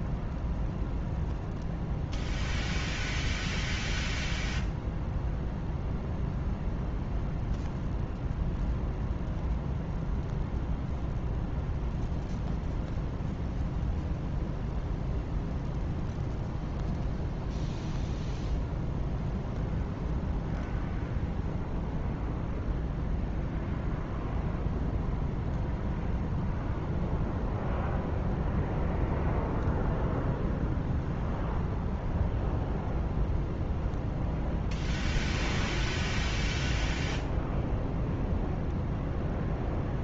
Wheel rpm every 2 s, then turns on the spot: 0, 0, 0, 0, 0, 0, 0, 0, 0, 0, 0, 0, 0, 0, 0, 0, 0, 0, 0, 0.
none